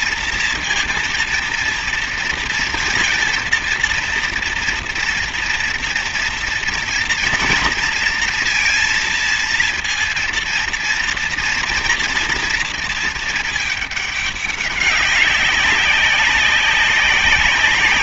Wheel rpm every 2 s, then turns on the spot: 230, 230, 230, 230, 230, 230, 230, 200, 190.
none